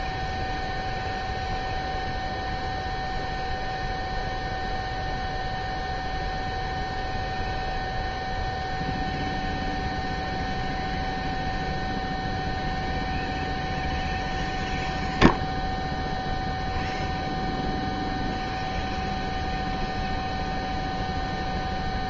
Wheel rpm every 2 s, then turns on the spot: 0, 0, 0, 0, 0, 0, 0, 0, 0, 0, 0.
none